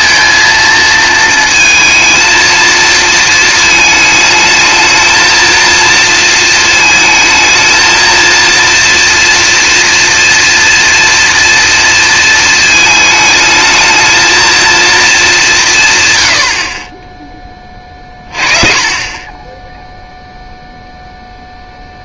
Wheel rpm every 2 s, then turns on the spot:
230, 230, 220, 220, 240, 240, 220, 230, 40, 30, 0.
none